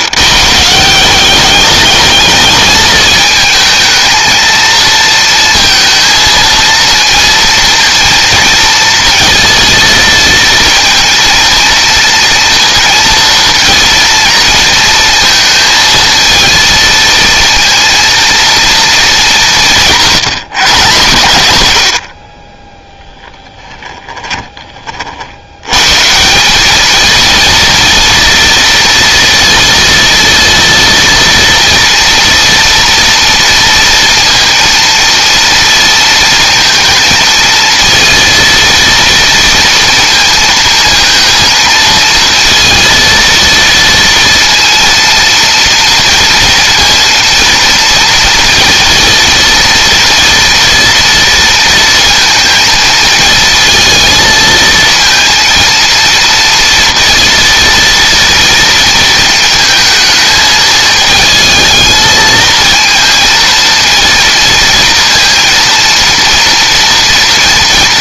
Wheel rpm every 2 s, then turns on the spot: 180, 220, 230, 230, 230, 230, 230, 230, 230, 220, 140, 10, 30, 210, 230, 230, 230, 230, 220, 230, 230, 230, 230, 230, 230, 230, 220, 230, 230, 230, 220, 230, 230, 230.
22-24